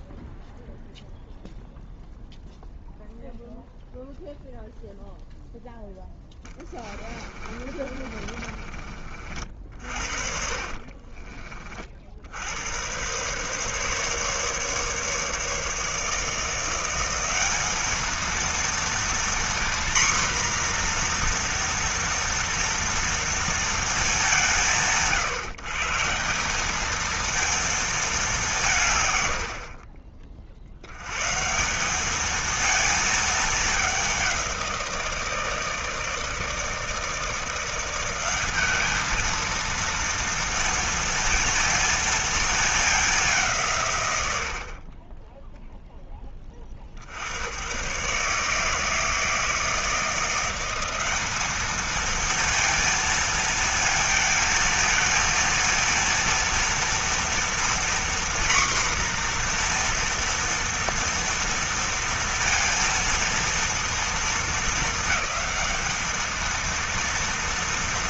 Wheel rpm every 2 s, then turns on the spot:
0, 0, 0, 20, 40, 40, 110, 150, 180, 230, 240, 230, 150, 210, 140, 90, 220, 170, 160, 220, 230, 200, 30, 50, 160, 190, 230, 230, 230, 250, 230, 230, 220, 230.
6-8 10-12